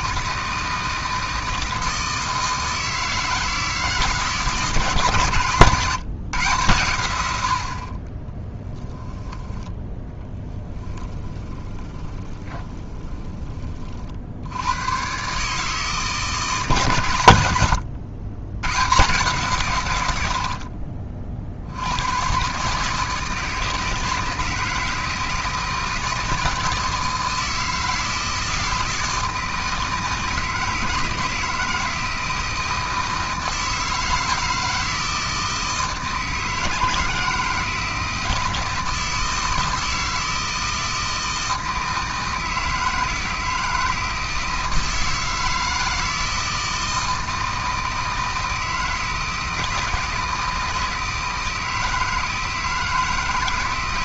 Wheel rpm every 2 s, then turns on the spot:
160, 160, 160, 120, 10, 20, 20, 110, 130, 130, 50, 150, 160, 160, 160, 160, 160, 160, 160, 160, 160, 160, 160, 160, 160, 160, 160.
10-14 20-22